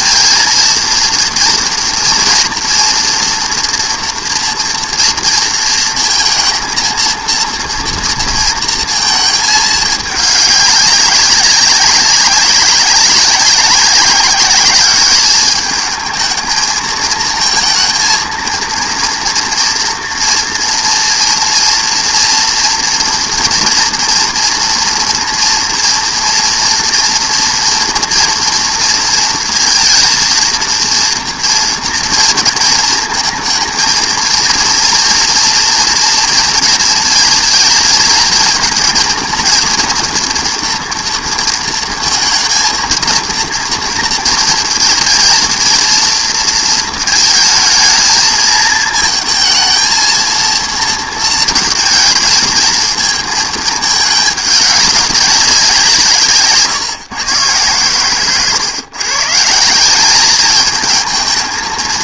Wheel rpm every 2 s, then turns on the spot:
230, 240, 230, 230, 230, 200, 190, 200, 220, 230, 230, 230, 230, 240, 230, 230, 230, 230, 230, 230, 230, 230, 230, 220, 220, 230, 230, 210, 150, 130, 210.
none